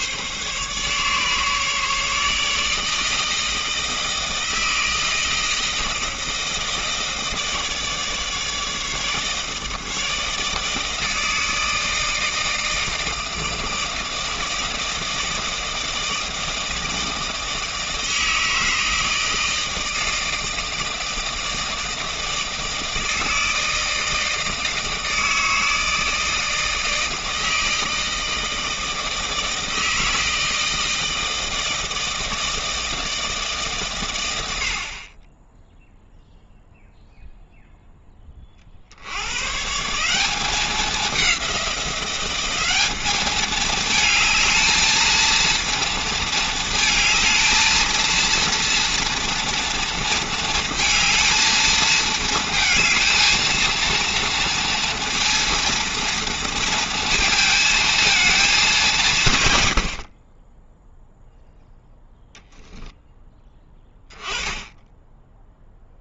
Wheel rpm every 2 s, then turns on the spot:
140, 160, 160, 160, 150, 160, 160, 160, 160, 160, 160, 160, 160, 160, 160, 160, 160, 50, 0, 60, 200, 200, 220, 220, 230, 220, 220, 230, 230, 190, 10, 10, 10.
none